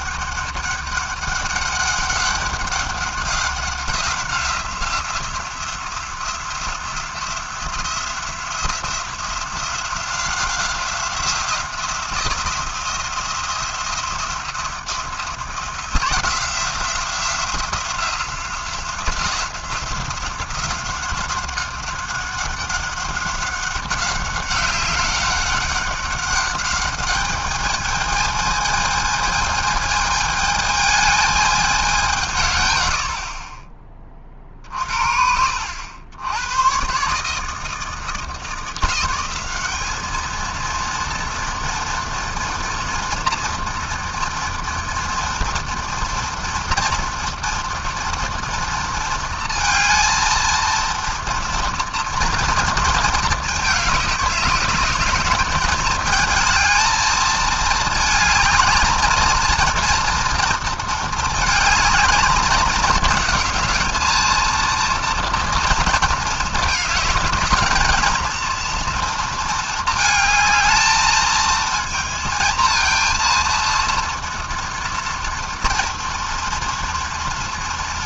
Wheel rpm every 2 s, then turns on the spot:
200, 190, 180, 180, 180, 180, 170, 170, 180, 180, 190, 190, 190, 210, 220, 220, 50, 60, 140, 190, 230, 230, 230, 230, 230, 230, 220, 200, 220, 230, 220, 220, 230, 220, 230, 220, 230, 230, 230.
none